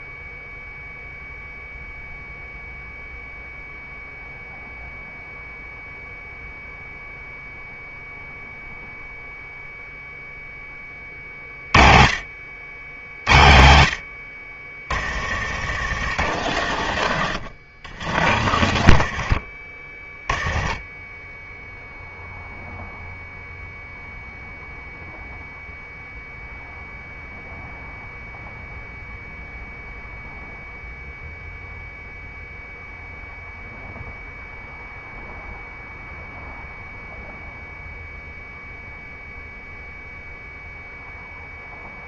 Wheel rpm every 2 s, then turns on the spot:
0, 0, 0, 0, 0, 20, 70, 60, 90, 80, 20, 0, 0, 0, 0, 0, 0, 0, 0, 0, 0.
14-16 18-22